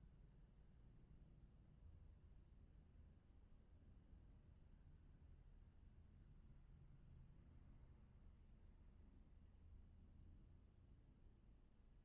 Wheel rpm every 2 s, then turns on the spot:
0, 0, 0, 0, 0, 0.
none